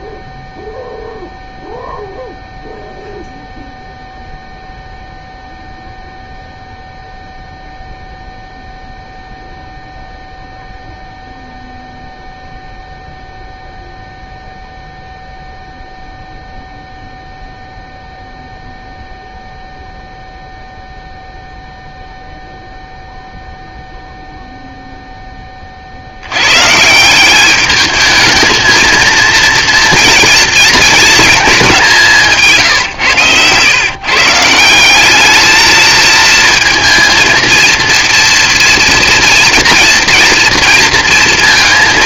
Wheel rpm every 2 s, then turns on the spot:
0, 0, 0, 0, 0, 0, 0, 0, 0, 0, 0, 0, 0, 130, 220, 230, 150, 160, 230, 230, 230.
32-34